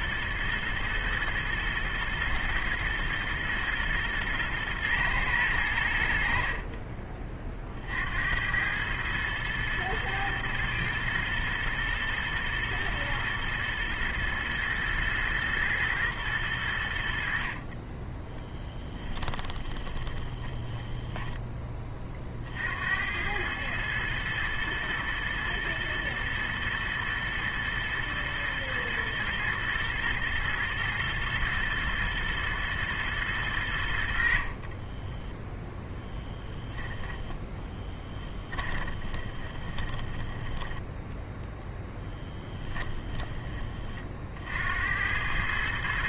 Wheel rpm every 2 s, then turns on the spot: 110, 120, 110, 50, 100, 110, 120, 110, 90, 10, 10, 70, 110, 110, 110, 120, 110, 30, 0, 20, 10, 20, 70.
18-22 34-36 38-44